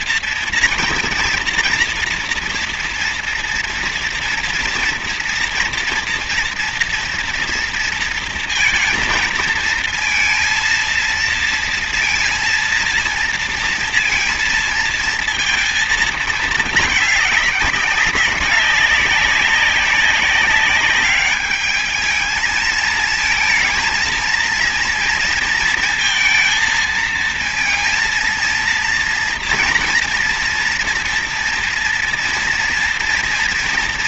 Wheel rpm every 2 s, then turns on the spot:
240, 240, 240, 230, 230, 230, 230, 230, 220, 190, 200, 220, 230, 230, 230, 230, 240.
none